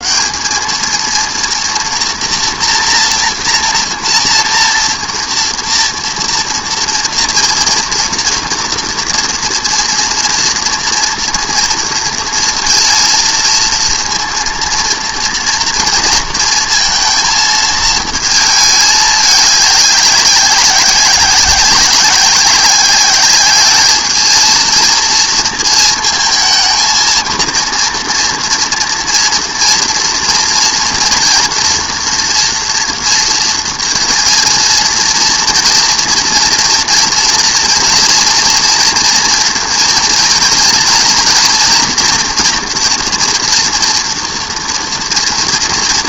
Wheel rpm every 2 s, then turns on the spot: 210, 240, 230, 230, 230, 230, 230, 230, 230, 220, 190, 190, 230, 220, 230, 230, 230, 230, 230, 230, 230, 230, 230.
none